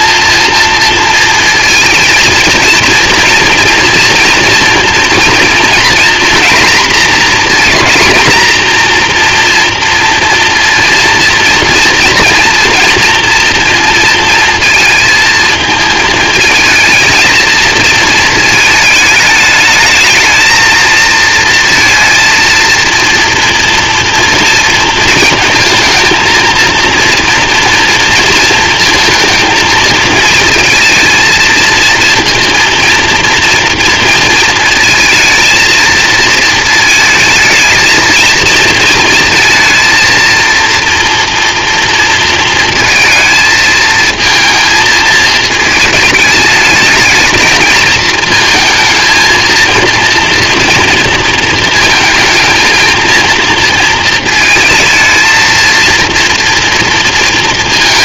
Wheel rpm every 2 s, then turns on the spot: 230, 220, 230, 230, 240, 230, 230, 230, 230, 220, 220, 230, 230, 230, 230, 230, 230, 220, 220, 220, 230, 230, 220, 220, 220, 230, 230, 220, 230.
none